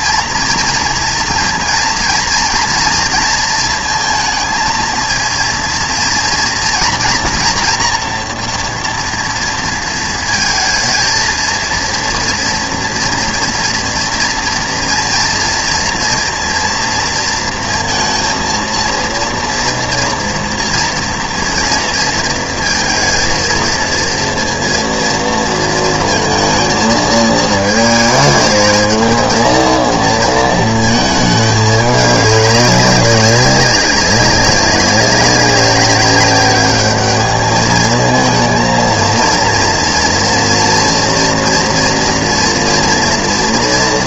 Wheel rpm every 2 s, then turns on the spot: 230, 230, 230, 240, 230, 220, 230, 240, 230, 230, 240, 230, 230, 230, 220, 220, 190, 200, 210, 230, 230, 230.
none